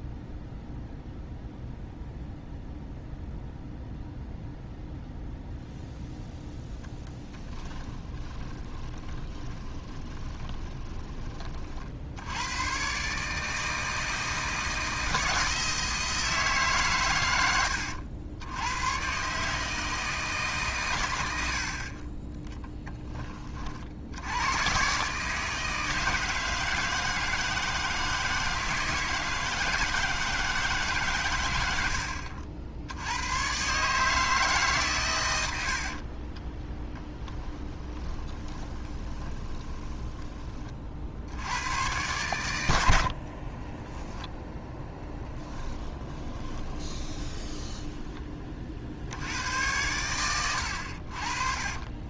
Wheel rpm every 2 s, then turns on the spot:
0, 0, 0, 0, 20, 20, 120, 160, 150, 100, 130, 10, 120, 160, 160, 140, 70, 130, 10, 20, 40, 90, 10, 30, 70, 80.
8-12 36-40 44-48 50-52